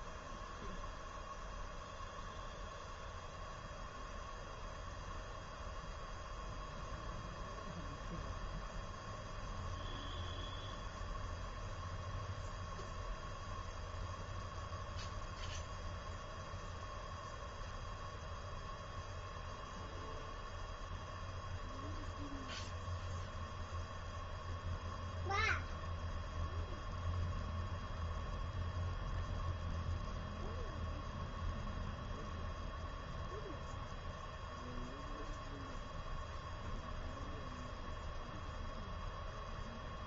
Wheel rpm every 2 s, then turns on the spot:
0, 0, 0, 0, 0, 0, 0, 0, 0, 0, 0, 0, 0, 0, 0, 0, 0, 0, 0, 0.
none